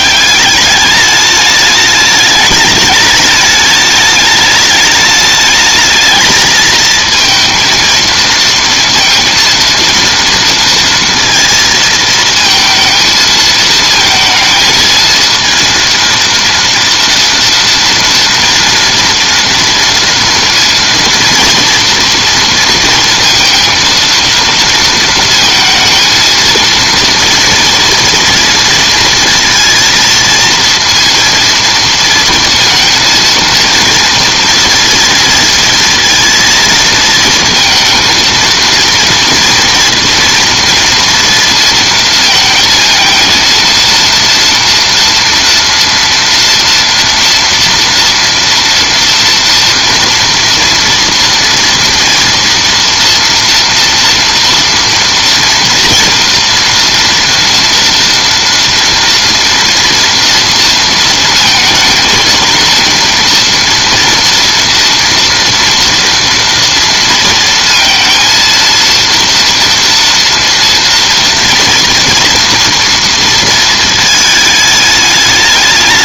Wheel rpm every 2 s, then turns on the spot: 200, 210, 210, 220, 230, 230, 230, 220, 230, 230, 230, 230, 230, 230, 230, 230, 230, 230, 230, 230, 230, 220, 230, 240, 240, 230, 230, 230, 230, 230, 230, 230, 230, 230, 230, 230, 230, 210.
none